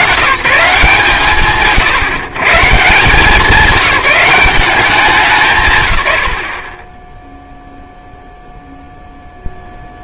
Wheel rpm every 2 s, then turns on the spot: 130, 140, 200, 50, 0.
none